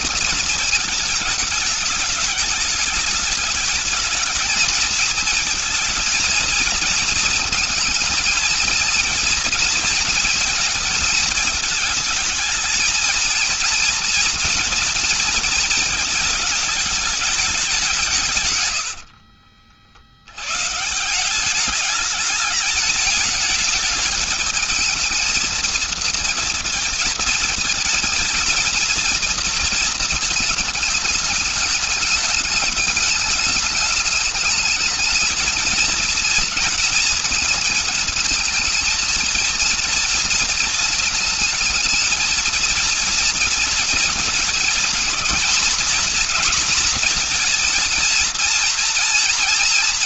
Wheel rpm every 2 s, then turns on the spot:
220, 210, 230, 230, 230, 220, 230, 230, 210, 60, 170, 210, 220, 230, 230, 210, 210, 220, 230, 230, 230, 230, 230, 240, 230.
18-20